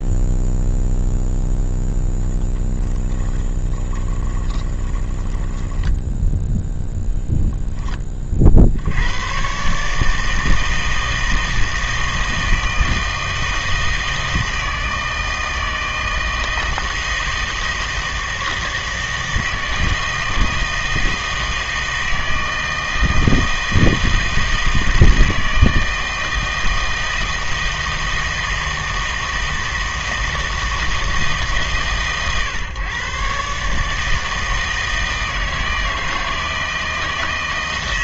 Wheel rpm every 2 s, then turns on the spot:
0, 10, 20, 0, 60, 160, 160, 160, 160, 160, 160, 160, 160, 160, 160, 160, 130, 160, 160.
2-6